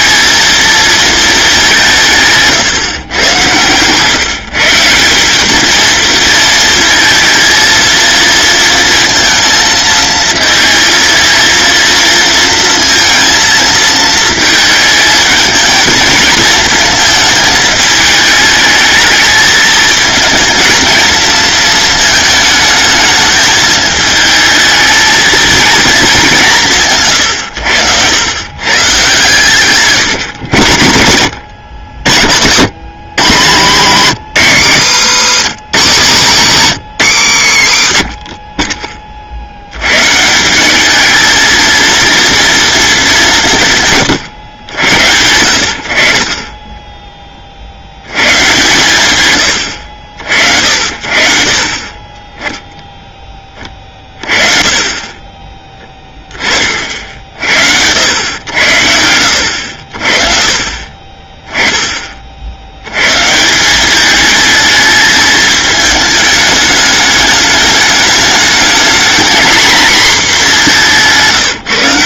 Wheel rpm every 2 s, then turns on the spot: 230, 130, 170, 230, 230, 230, 230, 220, 230, 220, 230, 220, 220, 140, 130, 100, 140, 160, 160, 30, 210, 210, 100, 20, 130, 60, 10, 30, 50, 90, 30, 100, 220, 210, 220, 190.
36-38